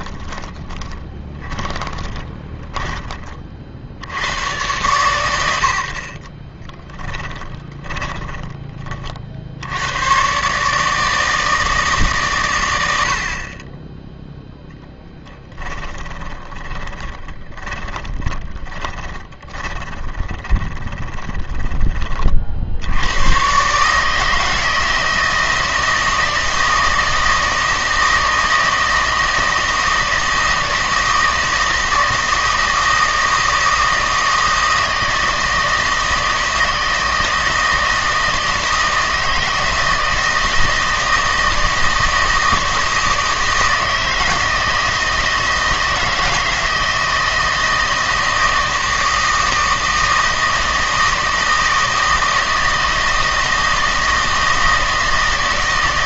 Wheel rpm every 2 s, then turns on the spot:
20, 20, 110, 10, 20, 150, 110, 0, 10, 20, 20, 70, 160, 160, 160, 160, 160, 160, 160, 160, 160, 160, 160, 160, 160, 160, 160, 160.
0-4 6-8 16-22